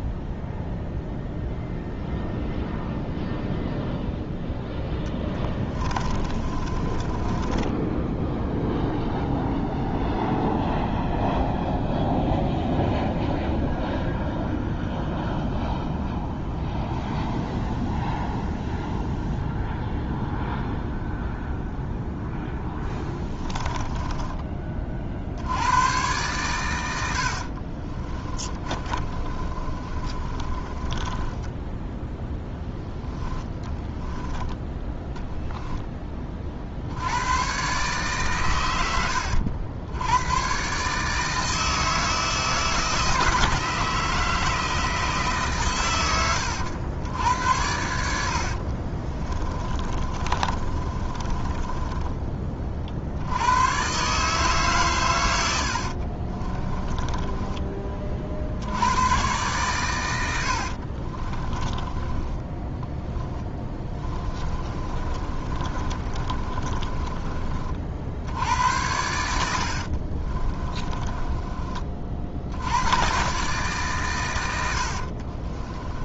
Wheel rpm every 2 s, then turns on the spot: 0, 0, 10, 20, 0, 0, 0, 0, 0, 0, 0, 10, 40, 90, 30, 20, 10, 10, 70, 110, 140, 160, 160, 90, 40, 30, 40, 120, 20, 90, 50, 10, 30, 30, 90, 20, 90, 80.
4-8 22-24 28-32 48-52 56-58 60-72 74-76